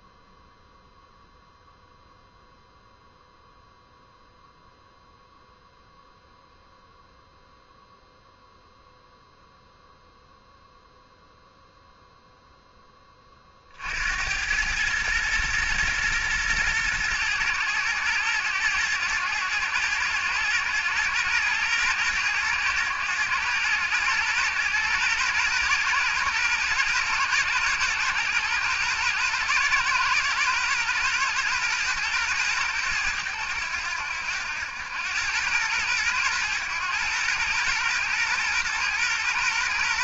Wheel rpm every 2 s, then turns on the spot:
0, 0, 0, 0, 0, 0, 10, 110, 110, 110, 110, 110, 120, 120, 120, 110, 110, 100, 110, 120.
none